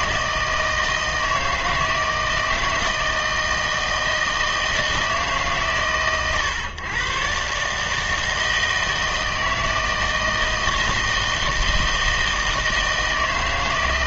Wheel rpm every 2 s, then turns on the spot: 160, 160, 160, 130, 160, 160, 160.
none